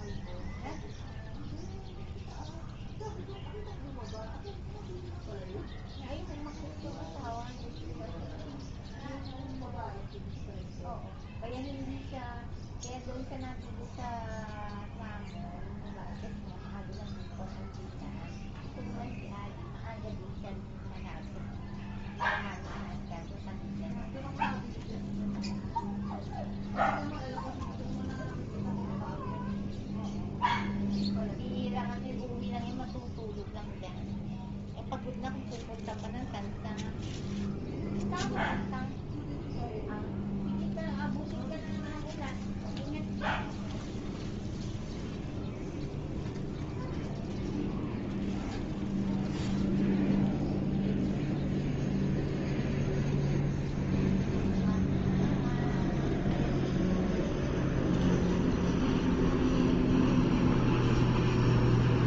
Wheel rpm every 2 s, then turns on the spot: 0, 0, 0, 0, 0, 0, 0, 0, 0, 0, 0, 0, 0, 0, 0, 0, 0, 0, 0, 0, 0, 0, 0, 0, 0, 0, 0, 0, 0, 0, 0.
none